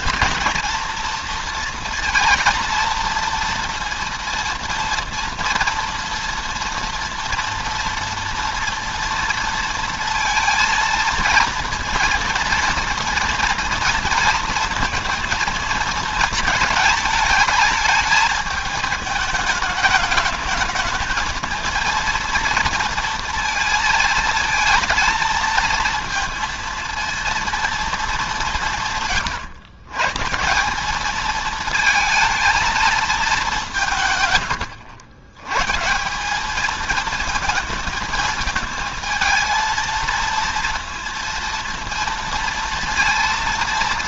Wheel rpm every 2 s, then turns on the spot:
230, 230, 230, 230, 230, 230, 230, 230, 220, 220, 220, 230, 230, 230, 160, 200, 220, 110, 220, 220, 230, 230.
none